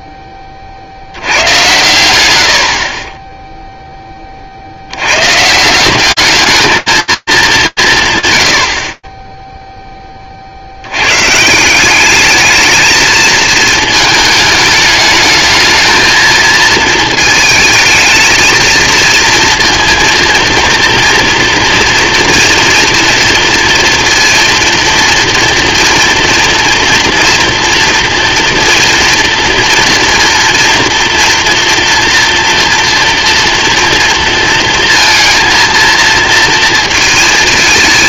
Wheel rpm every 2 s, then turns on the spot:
50, 50, 100, 220, 40, 120, 220, 210, 220, 230, 230, 230, 230, 230, 230, 230, 230, 230, 220.
none